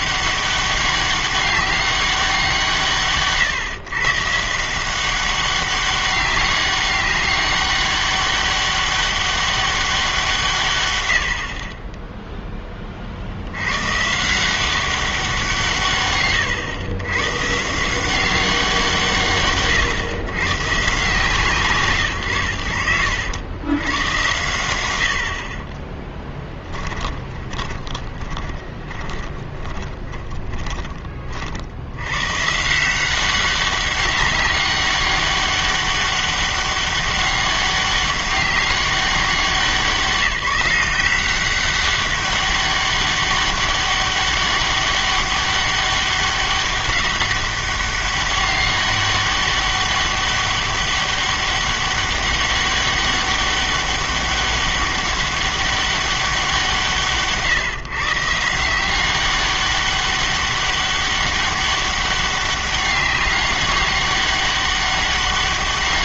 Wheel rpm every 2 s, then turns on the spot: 200, 170, 160, 200, 200, 150, 20, 180, 100, 170, 130, 100, 100, 20, 10, 10, 160, 190, 200, 190, 170, 200, 200, 200, 200, 200, 200, 200, 180, 170, 200, 200, 200.
26-30